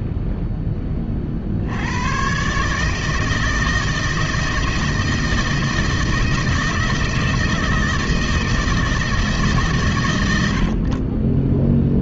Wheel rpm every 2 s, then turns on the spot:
50, 160, 160, 160, 170, 10.
none